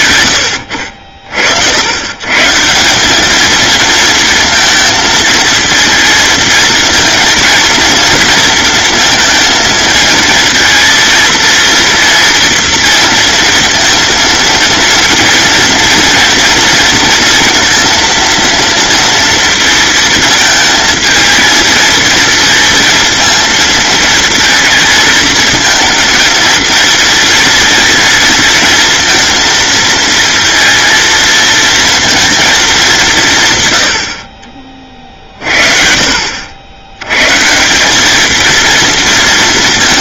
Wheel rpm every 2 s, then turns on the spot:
90, 160, 220, 230, 230, 230, 230, 230, 230, 230, 220, 230, 220, 230, 230, 230, 220, 40, 80, 230.
0-2